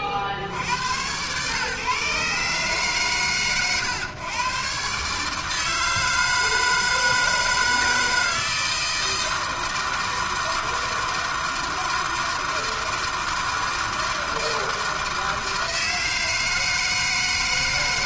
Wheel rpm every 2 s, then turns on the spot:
60, 130, 130, 160, 160, 160, 160, 160, 160.
none